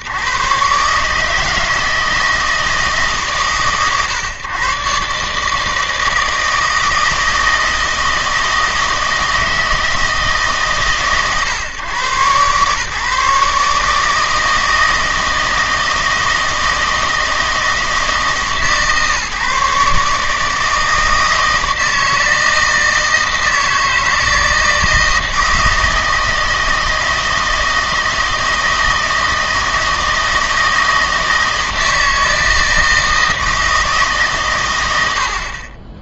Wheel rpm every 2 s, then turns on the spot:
120, 160, 130, 160, 160, 130, 140, 160, 160, 140, 160, 160, 160, 160, 160, 160, 160, 130.
none